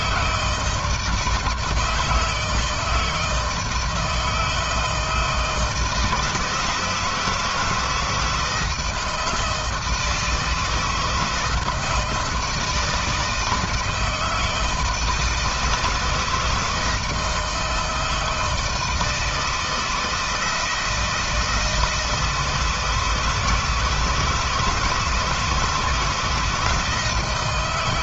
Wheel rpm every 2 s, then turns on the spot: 160, 160, 160, 170, 160, 160, 160, 160, 160, 160, 170, 160, 160, 160.
none